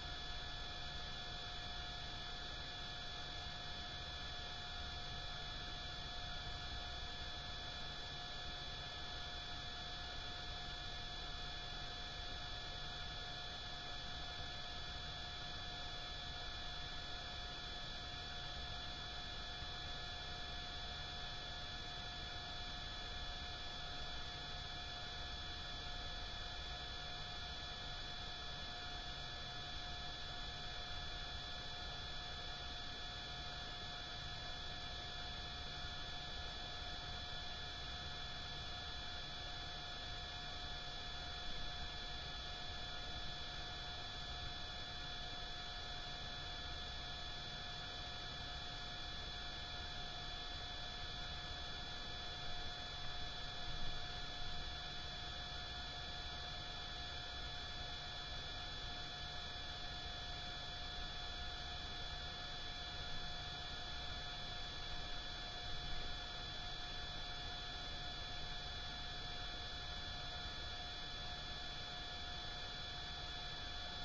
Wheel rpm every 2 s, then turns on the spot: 0, 0, 0, 0, 0, 0, 0, 0, 0, 0, 0, 0, 0, 0, 0, 0, 0, 0, 0, 0, 0, 0, 0, 0, 0, 0, 0, 0, 0, 0, 0, 0, 0, 0, 0, 0, 0.
none